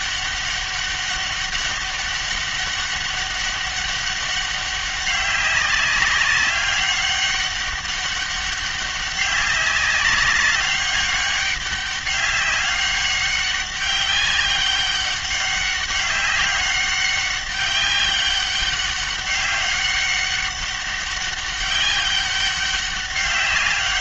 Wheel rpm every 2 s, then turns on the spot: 200, 200, 190, 200, 200, 200, 200, 200, 200, 200, 200, 190.
none